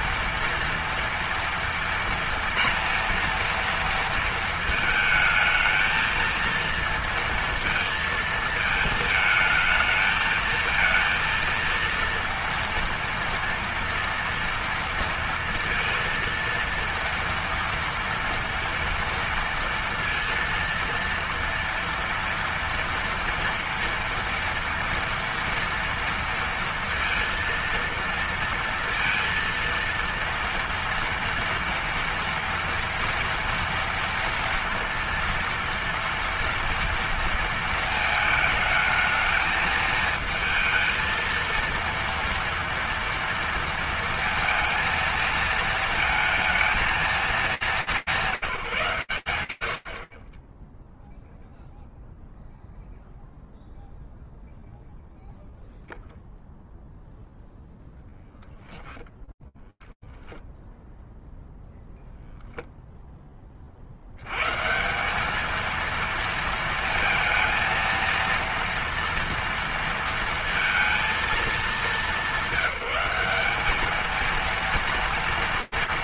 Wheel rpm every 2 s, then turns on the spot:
230, 230, 230, 230, 220, 230, 230, 230, 230, 230, 230, 230, 230, 230, 230, 230, 230, 230, 230, 220, 220, 230, 230, 220, 170, 10, 0, 0, 0, 0, 0, 20, 200, 230, 230, 210, 200, 230.
none